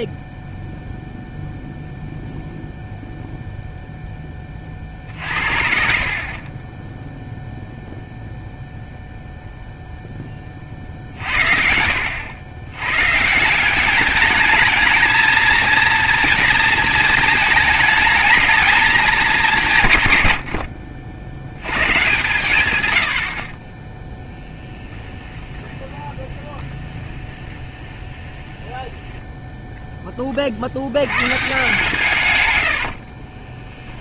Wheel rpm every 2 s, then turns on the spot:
0, 0, 20, 30, 0, 30, 100, 210, 230, 210, 90, 110, 10, 30, 10, 30, 130.
24-30